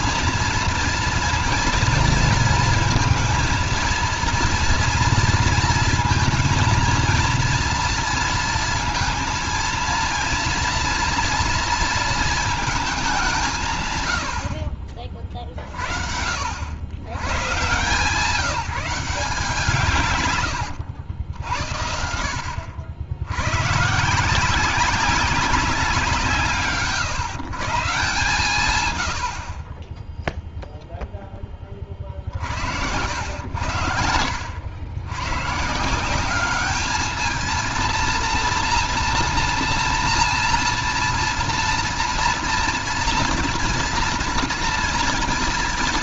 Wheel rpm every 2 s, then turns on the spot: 230, 230, 230, 230, 230, 240, 210, 50, 90, 180, 90, 90, 190, 150, 120, 0, 80, 90, 210, 230, 230, 230, 230.
none